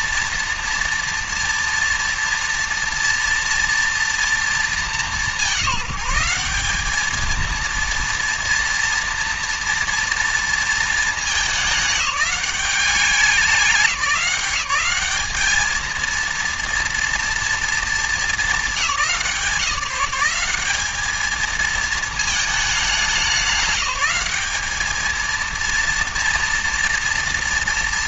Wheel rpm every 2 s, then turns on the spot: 230, 230, 210, 210, 230, 220, 200, 200, 230, 180, 210, 200, 210, 230.
none